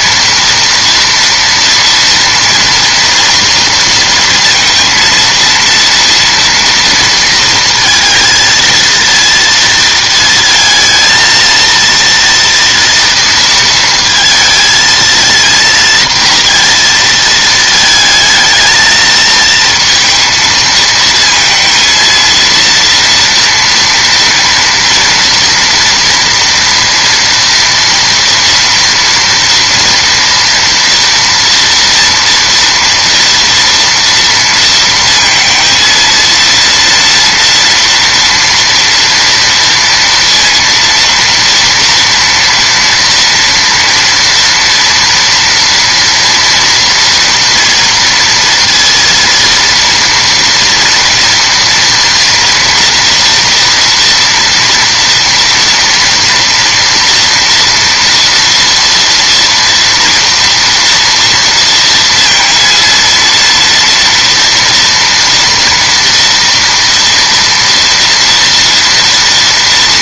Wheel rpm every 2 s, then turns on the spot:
230, 230, 230, 230, 230, 230, 230, 230, 230, 220, 220, 230, 230, 230, 230, 230, 230, 230, 230, 240, 230, 230, 240, 230, 230, 230, 230, 230, 230, 230, 230, 230, 230, 230, 230.
none